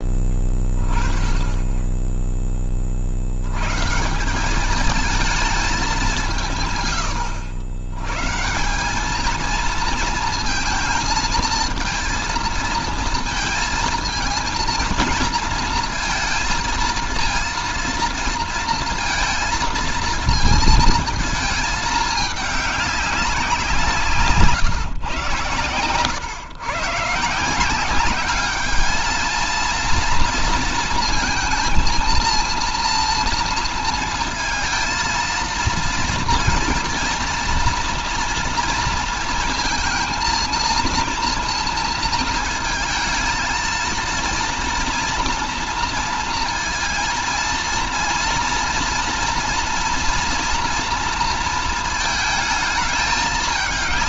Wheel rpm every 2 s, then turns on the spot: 20, 20, 180, 170, 140, 230, 230, 230, 230, 230, 230, 210, 140, 120, 200, 230, 230, 220, 230, 230, 230, 230, 230, 230, 230, 230, 220.
none